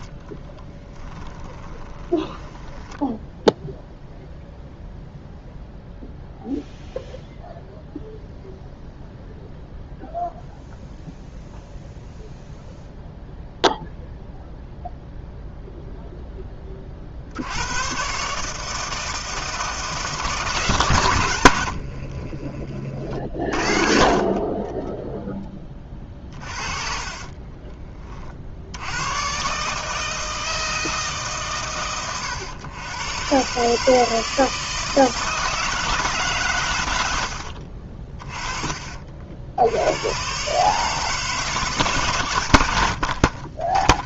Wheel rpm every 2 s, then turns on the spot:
20, 10, 0, 0, 0, 0, 0, 0, 20, 150, 130, 30, 30, 40, 70, 160, 100, 160, 120, 30, 140, 80.
0-4 24-28